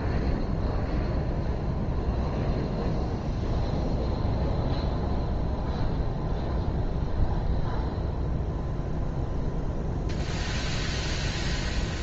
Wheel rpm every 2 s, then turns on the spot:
0, 0, 0, 0, 0, 0.
none